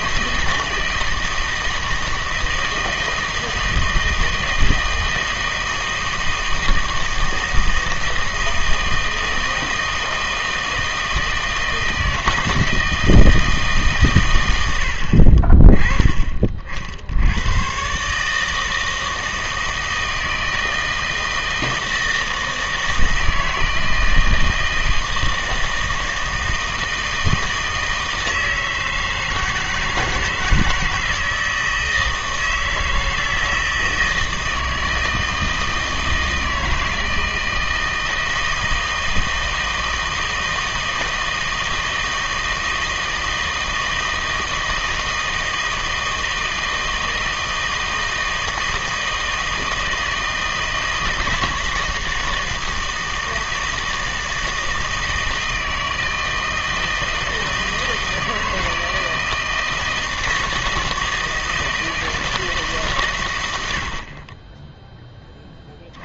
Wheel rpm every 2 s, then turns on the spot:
160, 160, 160, 160, 160, 160, 160, 100, 50, 160, 160, 160, 160, 160, 160, 160, 160, 160, 160, 160, 160, 160, 160, 160, 160, 160, 160, 160, 160, 160, 160, 160, 20.
none